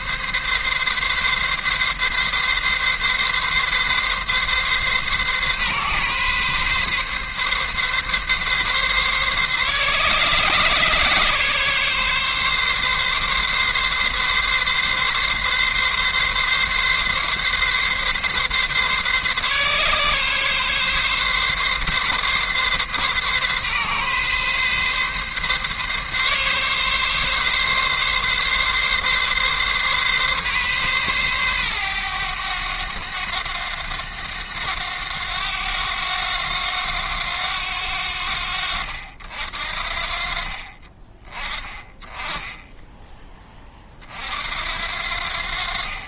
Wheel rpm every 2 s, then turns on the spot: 140, 140, 140, 140, 140, 140, 140, 140, 140, 140, 140, 140, 140, 140, 140, 130, 100, 90, 90, 70, 30, 20, 70.
none